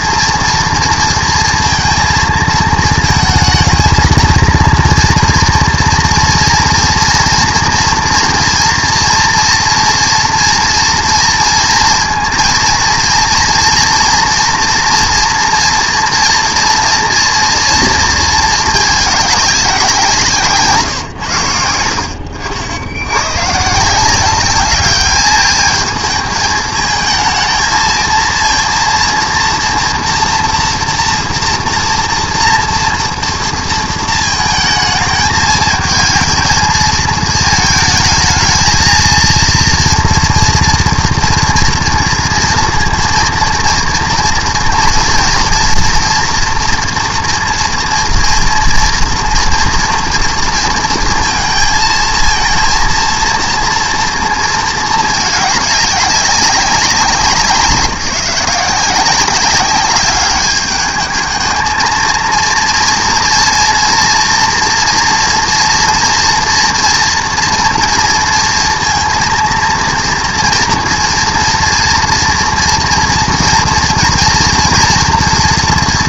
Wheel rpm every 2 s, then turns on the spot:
230, 220, 230, 230, 230, 240, 230, 240, 230, 210, 160, 80, 200, 220, 230, 230, 230, 220, 220, 220, 230, 230, 230, 240, 230, 230, 230, 230, 190, 180, 200, 230, 240, 240, 230, 230, 230, 230.
none